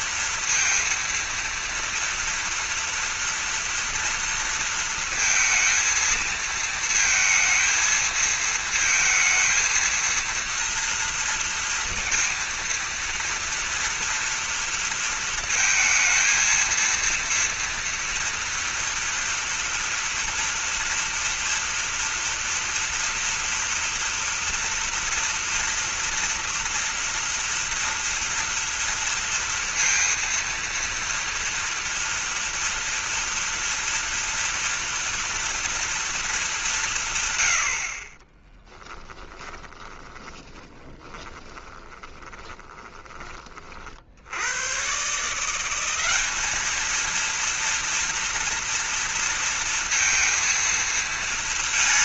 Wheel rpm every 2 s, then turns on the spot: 230, 240, 230, 230, 220, 230, 230, 230, 230, 240, 240, 230, 240, 230, 230, 230, 240, 240, 180, 10, 20, 20, 120, 210, 230, 230.
38-44